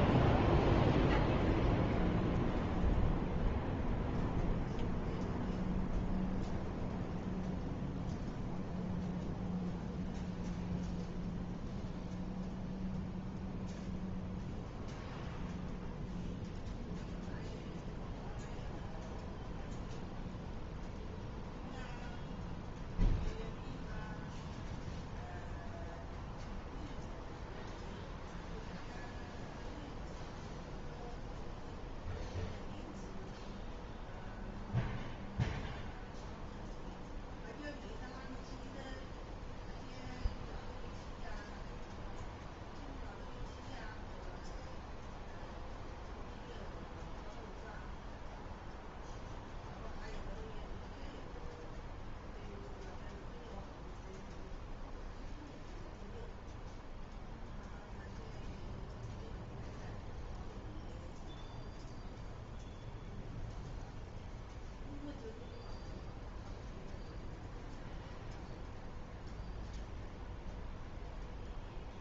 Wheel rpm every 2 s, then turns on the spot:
0, 0, 0, 0, 0, 0, 0, 0, 0, 0, 0, 0, 0, 0, 0, 0, 0, 0, 0, 0, 0, 0, 0, 0, 0, 0, 0, 0, 0, 0, 0, 0, 0, 0, 0, 0.
none